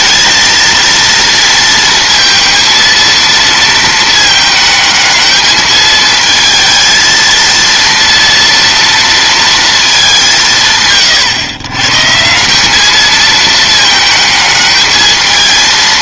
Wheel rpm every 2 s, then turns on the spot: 230, 230, 220, 220, 230, 150, 190, 220.
none